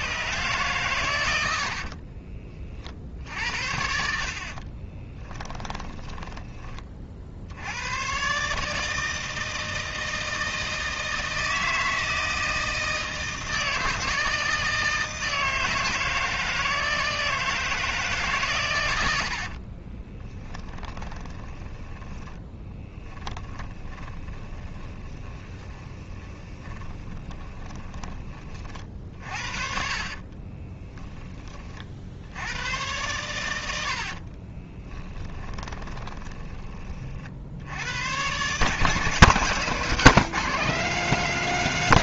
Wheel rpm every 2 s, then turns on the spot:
130, 50, 30, 30, 150, 160, 160, 160, 160, 110, 20, 10, 20, 20, 40, 20, 100, 40, 30, 150, 190.
4-6 20-28 30-32 34-36